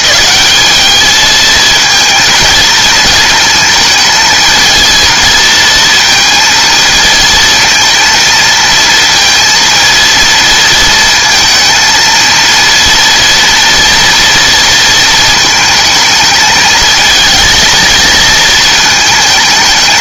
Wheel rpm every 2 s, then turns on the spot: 210, 230, 220, 230, 230, 230, 230, 230, 220, 220.
none